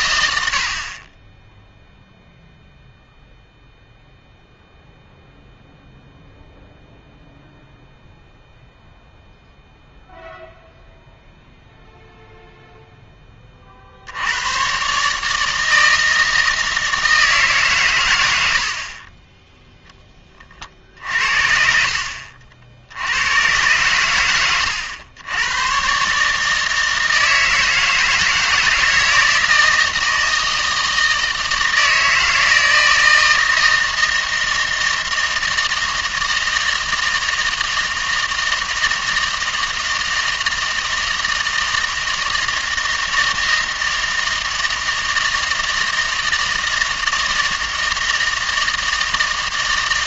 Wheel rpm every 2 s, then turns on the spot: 60, 0, 0, 0, 0, 0, 0, 120, 160, 60, 40, 60, 100, 160, 160, 160, 160, 160, 160, 160, 160, 160, 160, 160, 160.
none